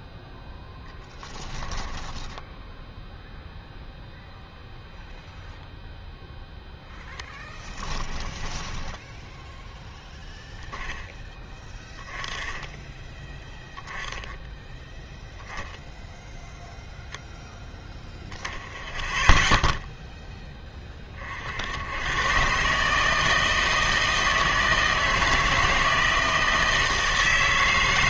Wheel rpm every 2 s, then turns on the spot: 0, 10, 0, 0, 10, 0, 10, 10, 0, 0, 10, 130, 160, 160.
8-10